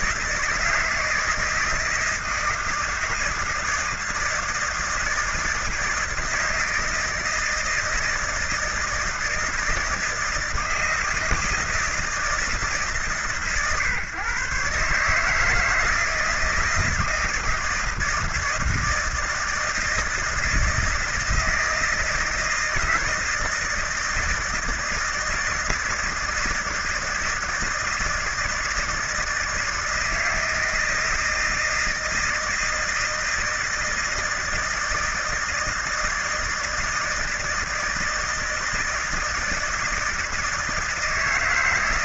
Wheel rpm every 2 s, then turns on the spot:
160, 160, 160, 160, 160, 160, 160, 150, 170, 160, 160, 160, 160, 160, 160, 160, 160, 160, 160, 160, 160.
none